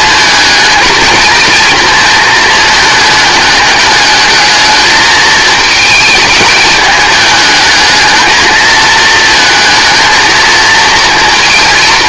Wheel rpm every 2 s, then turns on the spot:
230, 230, 210, 220, 220, 230.
none